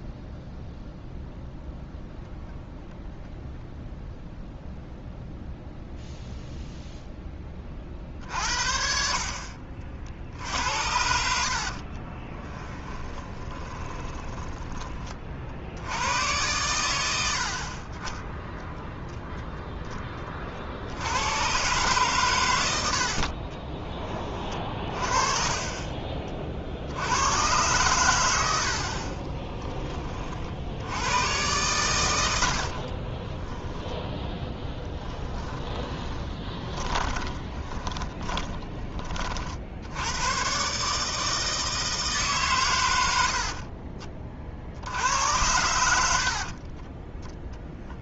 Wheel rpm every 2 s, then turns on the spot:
0, 0, 0, 0, 50, 70, 20, 20, 100, 0, 60, 90, 40, 60, 60, 70, 50, 10, 20, 20, 140, 120, 60, 30.
12-14 34-38 46-48